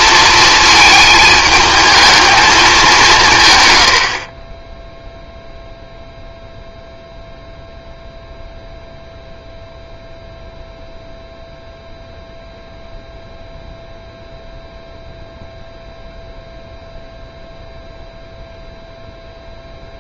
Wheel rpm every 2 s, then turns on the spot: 220, 190, 10, 0, 0, 0, 0, 0, 0, 0.
none